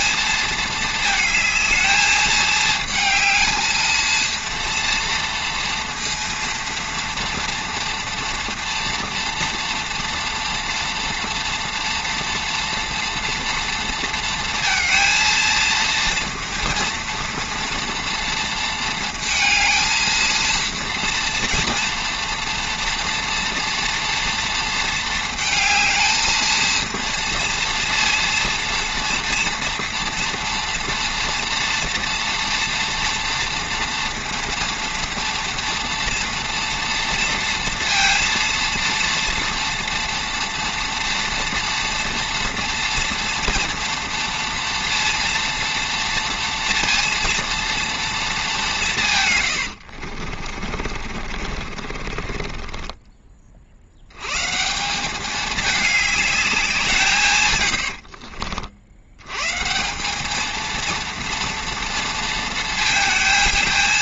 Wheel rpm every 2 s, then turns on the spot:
220, 220, 230, 230, 230, 230, 230, 230, 230, 230, 230, 230, 230, 230, 230, 230, 240, 230, 230, 230, 230, 230, 230, 230, 200, 50, 30, 150, 190, 50, 220, 230.
50-54